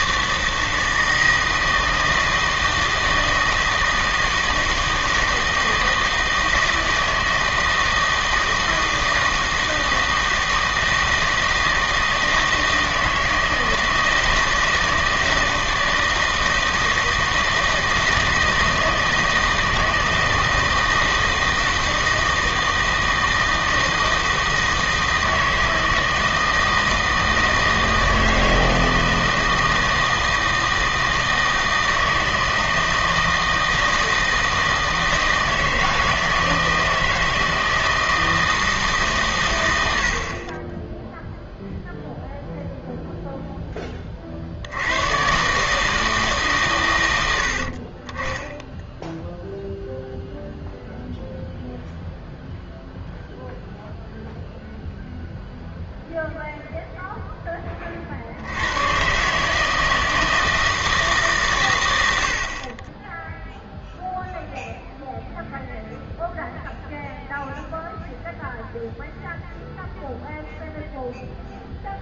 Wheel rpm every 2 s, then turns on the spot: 160, 160, 160, 160, 160, 160, 160, 160, 160, 160, 160, 160, 160, 160, 160, 160, 160, 160, 160, 160, 20, 0, 70, 120, 0, 0, 0, 0, 0, 100, 160, 40, 0, 0, 0, 0.
none